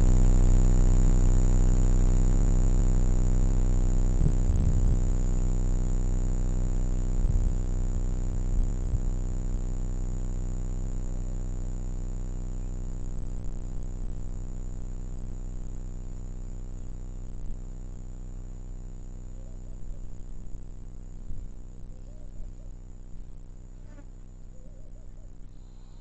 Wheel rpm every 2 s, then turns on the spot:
0, 0, 0, 0, 0, 0, 0, 0, 0, 0, 0, 0, 0.
none